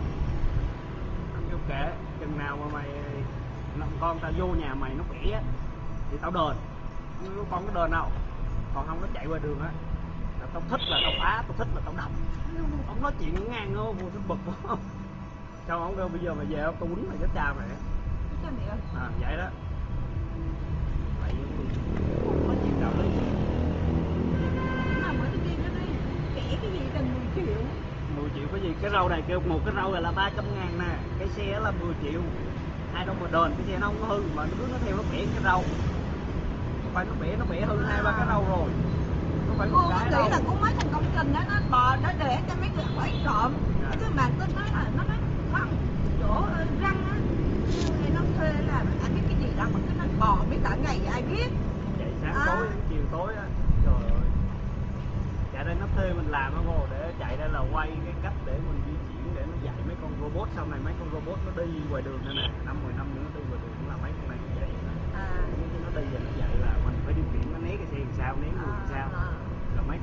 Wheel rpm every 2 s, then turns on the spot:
0, 0, 0, 0, 0, 0, 0, 0, 0, 0, 0, 0, 0, 0, 0, 0, 0, 0, 0, 0, 0, 0, 0, 0, 0, 0, 0, 0, 0, 0, 0, 0, 0, 0, 0.
none